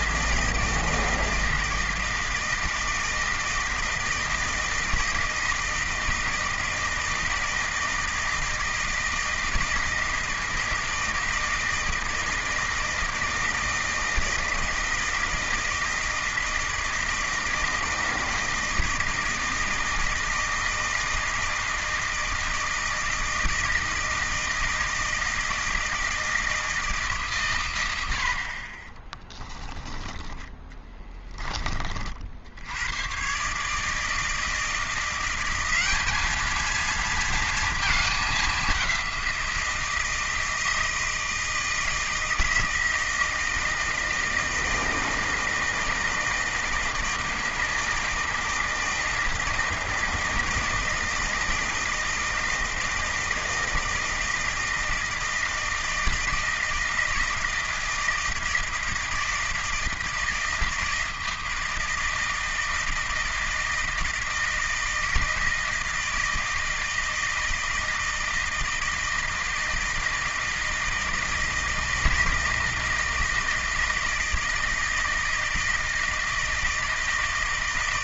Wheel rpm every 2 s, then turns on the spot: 160, 160, 160, 160, 160, 160, 160, 160, 160, 160, 160, 160, 160, 160, 50, 10, 80, 170, 220, 200, 160, 160, 160, 160, 160, 160, 160, 160, 160, 160, 160, 160, 160, 160, 160, 160, 160, 160, 160.
none